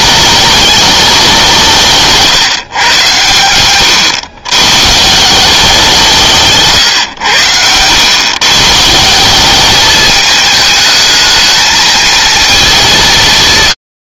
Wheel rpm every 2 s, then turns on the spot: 210, 130, 130, 140, 150, 210, 190.
6-8